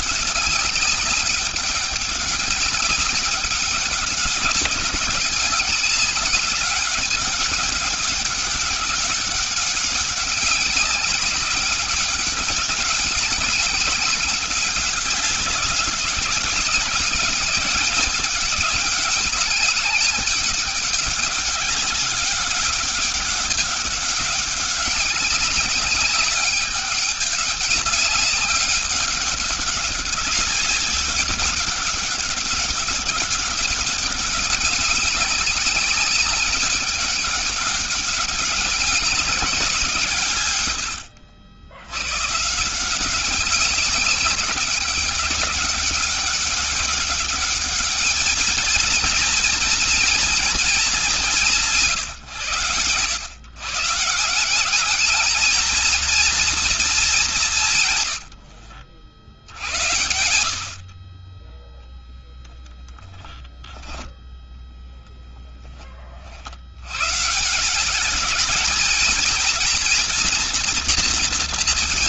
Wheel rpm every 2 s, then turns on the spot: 200, 200, 200, 200, 200, 200, 200, 190, 200, 210, 200, 200, 200, 200, 200, 190, 200, 200, 200, 200, 100, 160, 200, 200, 220, 190, 110, 200, 210, 50, 50, 10, 10, 90, 230, 230.
64-66